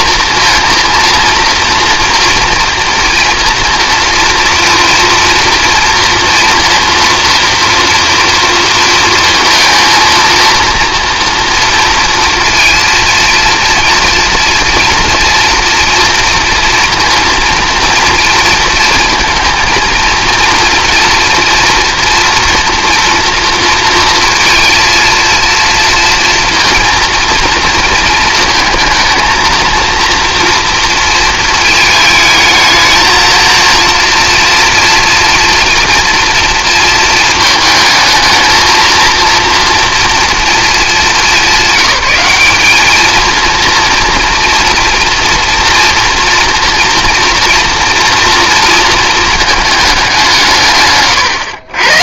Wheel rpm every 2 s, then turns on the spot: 230, 230, 230, 230, 230, 230, 230, 240, 230, 220, 230, 230, 230, 230, 230, 230, 220, 230, 230, 230, 220, 210, 230, 240, 230, 140.
50-52